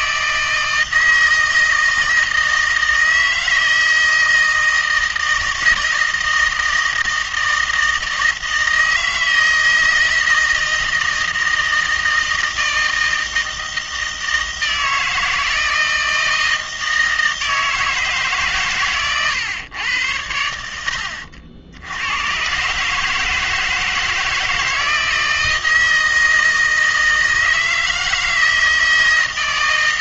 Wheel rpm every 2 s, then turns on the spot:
160, 160, 160, 160, 160, 160, 160, 160, 160, 140, 90, 120, 160, 160, 160.
none